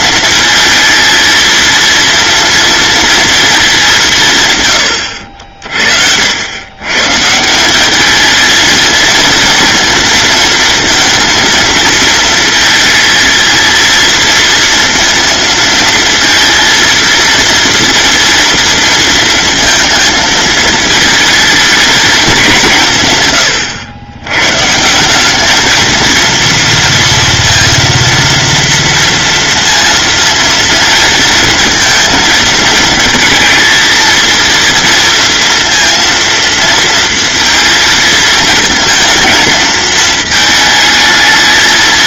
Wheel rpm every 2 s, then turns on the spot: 230, 230, 110, 130, 230, 230, 230, 230, 230, 230, 220, 150, 170, 230, 230, 230, 230, 230, 230, 230, 220.
none